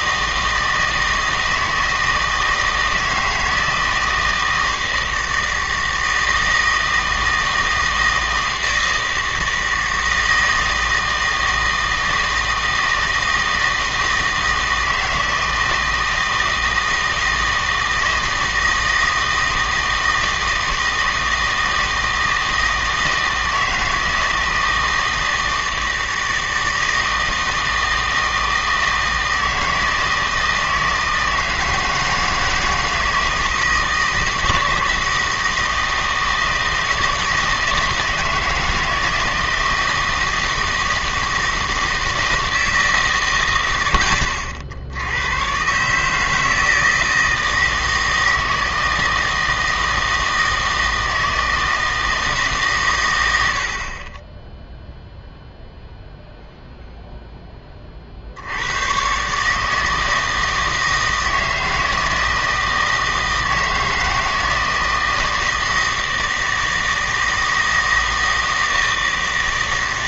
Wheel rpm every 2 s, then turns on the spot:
160, 160, 160, 160, 160, 160, 160, 160, 160, 160, 160, 160, 160, 160, 160, 160, 160, 160, 160, 160, 160, 160, 80, 160, 160, 160, 140, 0, 0, 90, 160, 160, 160, 160, 160.
none